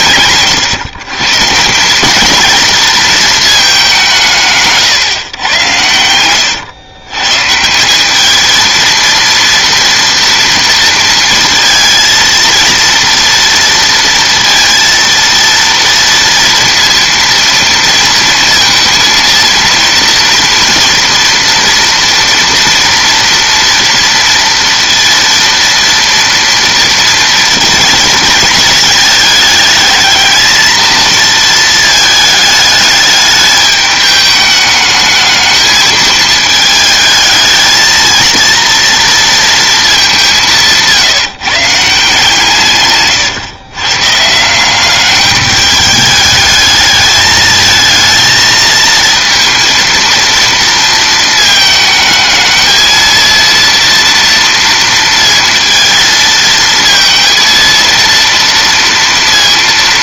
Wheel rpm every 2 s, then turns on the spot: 140, 230, 130, 120, 230, 230, 230, 230, 230, 230, 230, 230, 230, 230, 220, 220, 210, 210, 220, 230, 160, 130, 190, 220, 230, 230, 220, 230, 230, 230.
none